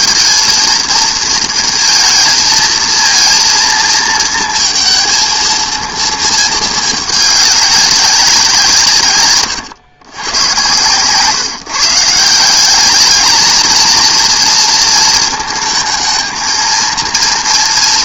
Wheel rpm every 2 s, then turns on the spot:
230, 230, 230, 220, 170, 110, 190, 230, 230.
none